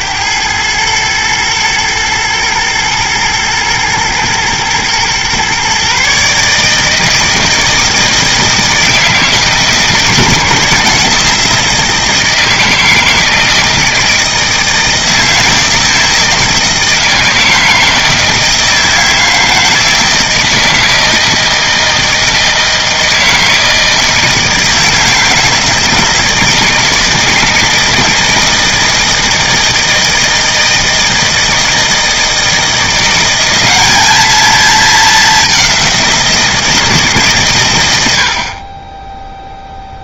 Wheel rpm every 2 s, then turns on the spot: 110, 110, 120, 160, 160, 160, 160, 160, 160, 160, 160, 160, 160, 160, 160, 160, 170, 210, 160, 20.
none